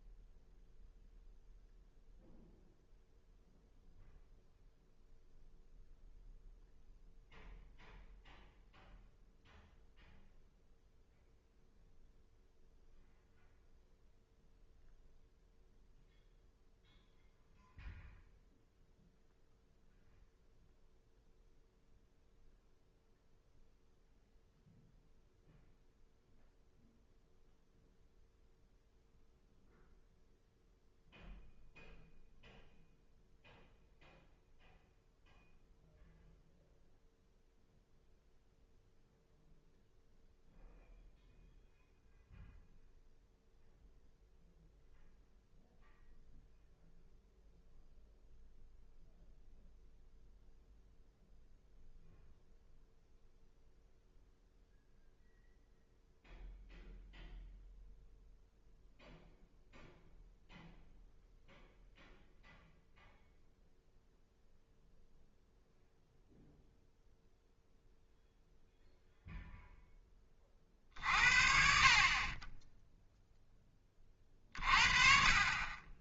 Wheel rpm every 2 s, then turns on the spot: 0, 0, 0, 0, 0, 0, 0, 0, 0, 0, 0, 0, 0, 0, 0, 0, 0, 0, 0, 0, 0, 0, 0, 0, 0, 0, 0, 0, 0, 0, 0, 0, 0, 0, 0, 50, 10, 40.
none